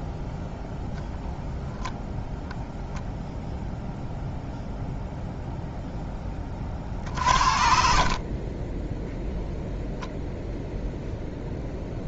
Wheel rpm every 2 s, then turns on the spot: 0, 0, 0, 40, 10, 0.
6-10